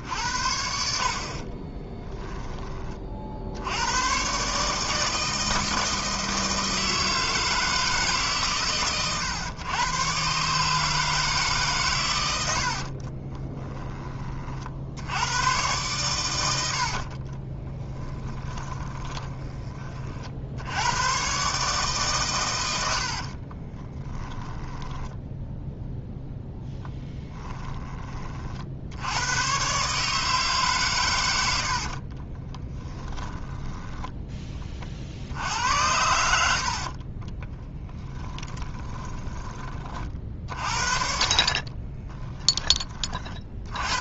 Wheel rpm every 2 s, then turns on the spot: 60, 30, 150, 160, 130, 150, 50, 80, 50, 20, 100, 70, 10, 10, 80, 130, 30, 50, 40, 10, 50, 30.
12-14 16-20 22-28 32-34 38-42